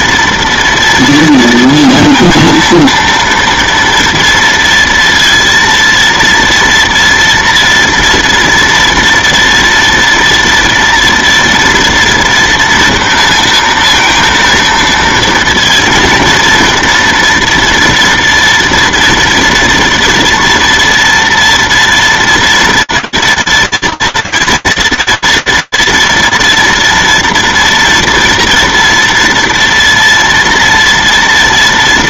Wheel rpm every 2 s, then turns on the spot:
230, 230, 230, 230, 230, 230, 230, 230, 230, 240, 240, 230, 230, 230, 230, 230.
none